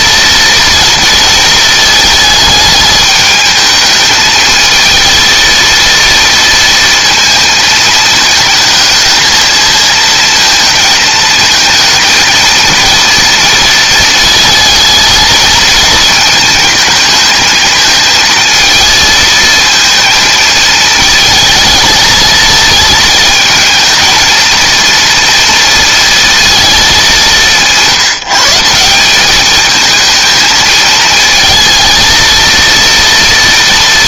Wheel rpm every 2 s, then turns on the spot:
230, 220, 220, 230, 220, 230, 230, 230, 220, 220, 220, 220, 230, 230, 170, 220, 230.
none